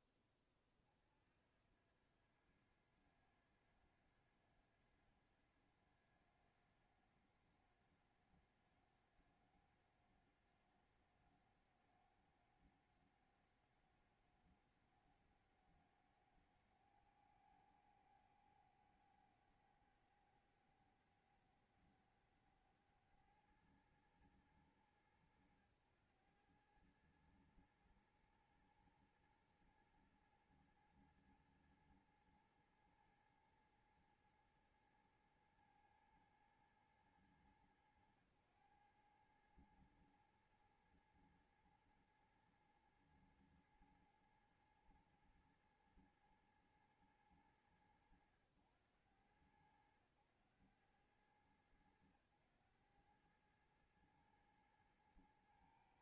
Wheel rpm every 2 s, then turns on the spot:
30, 90, 90, 90, 90, 90, 90, 90, 100, 100, 100, 100, 100, 100, 110, 110, 110, 110, 110, 100, 110, 110, 110, 110, 90, 100, 100, 110.
none